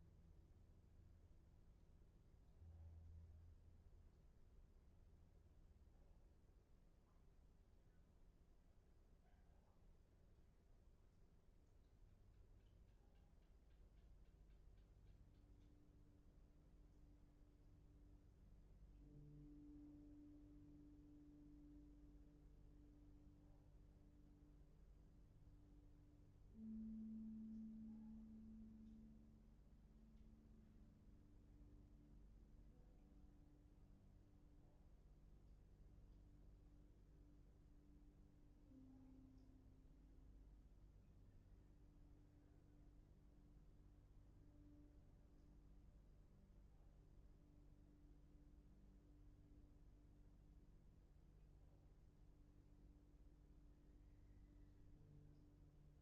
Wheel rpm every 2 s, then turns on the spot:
0, 0, 0, 0, 0, 0, 0, 0, 0, 0, 0, 0, 0, 0, 0, 0, 0, 0, 0, 0, 0, 0, 0, 0, 0, 0, 0, 0.
none